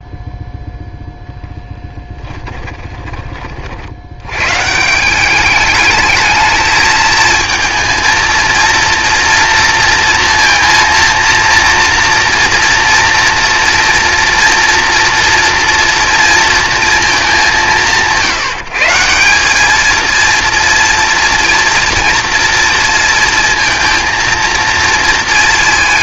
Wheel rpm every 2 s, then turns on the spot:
0, 20, 130, 220, 230, 230, 230, 230, 230, 160, 230, 230, 230.
2-4